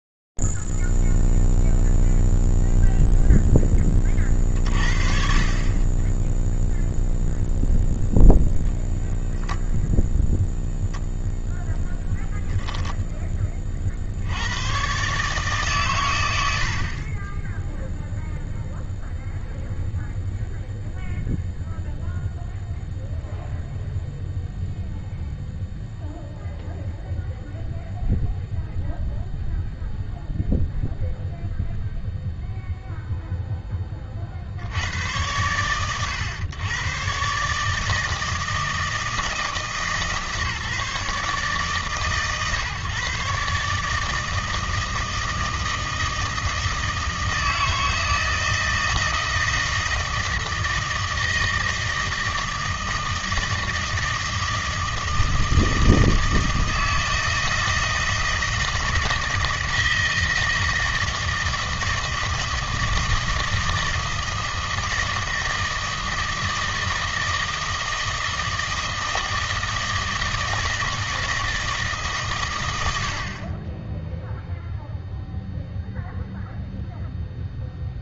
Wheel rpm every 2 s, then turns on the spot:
0, 0, 20, 30, 0, 0, 0, 60, 100, 0, 0, 0, 0, 0, 0, 0, 0, 70, 110, 160, 150, 140, 160, 160, 160, 160, 160, 160, 160, 160, 160, 160, 160, 160, 160, 160, 100, 0, 0.
none